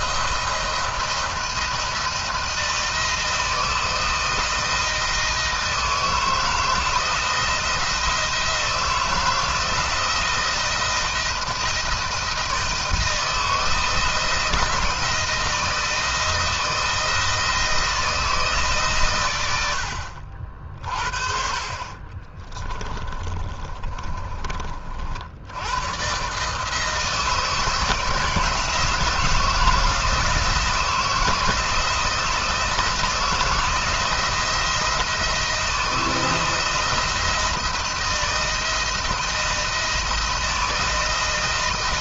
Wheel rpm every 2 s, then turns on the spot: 170, 170, 160, 160, 160, 160, 160, 170, 160, 140, 50, 30, 50, 160, 160, 160, 160, 170, 170, 160, 160.
22-24